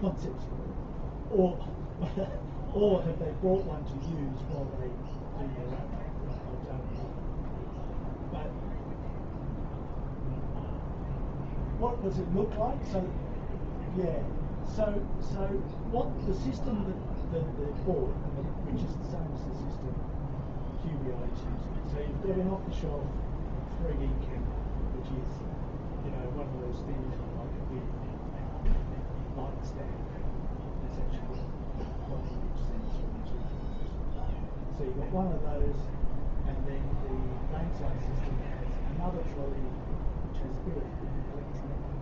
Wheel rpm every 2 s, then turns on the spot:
0, 0, 0, 0, 0, 0, 0, 0, 0, 0, 0, 0, 0, 0, 0, 0, 0, 0, 0, 0, 0.
none